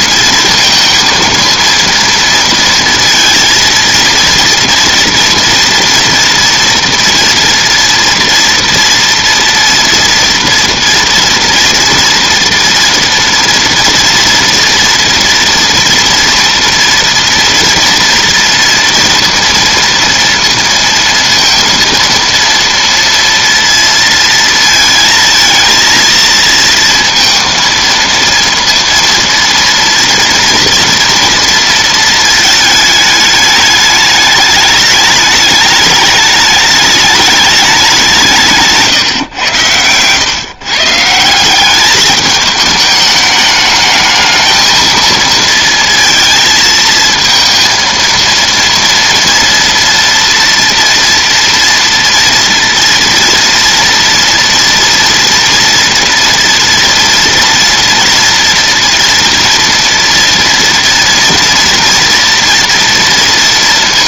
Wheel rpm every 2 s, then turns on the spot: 230, 230, 230, 230, 230, 230, 230, 230, 230, 230, 230, 230, 230, 230, 230, 230, 220, 210, 220, 150, 130, 210, 220, 220, 230, 230, 230, 240, 230, 230, 230, 230.
none